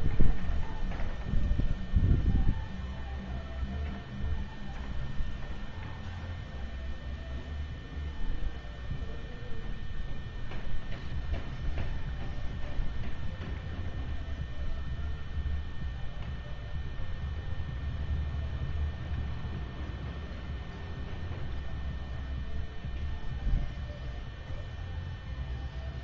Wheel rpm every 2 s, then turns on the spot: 0, 0, 0, 0, 0, 0, 0, 0, 0, 0, 0, 0, 0.
none